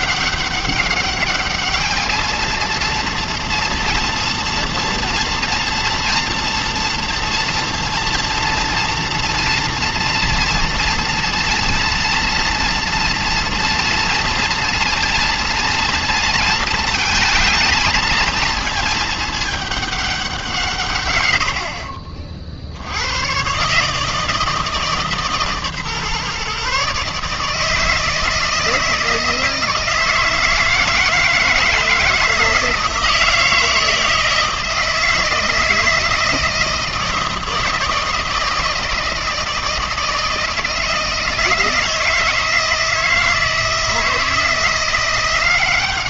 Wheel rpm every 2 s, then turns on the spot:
200, 220, 230, 230, 230, 230, 230, 230, 220, 220, 170, 60, 160, 140, 160, 160, 160, 160, 160, 160, 160, 160, 160.
none